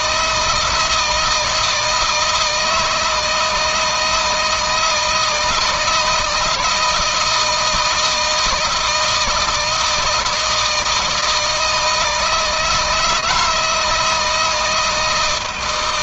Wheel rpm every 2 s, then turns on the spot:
160, 160, 160, 160, 170, 160, 160, 160.
none